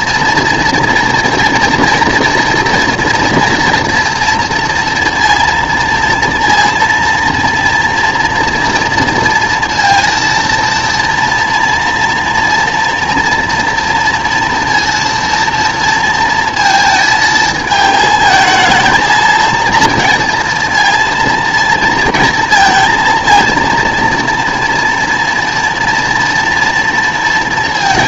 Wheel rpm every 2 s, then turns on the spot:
230, 230, 230, 230, 230, 230, 230, 230, 220, 230, 230, 230, 230, 230.
none